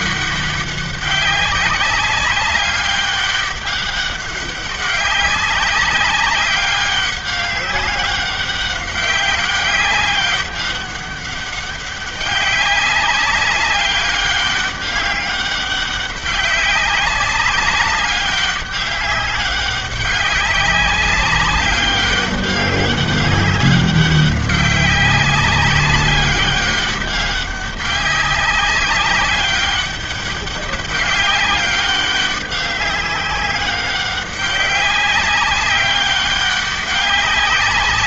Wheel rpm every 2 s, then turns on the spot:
200, 200, 190, 190, 190, 200, 190, 190, 200, 200, 200, 200, 200, 200, 200, 200, 200, 200, 200.
none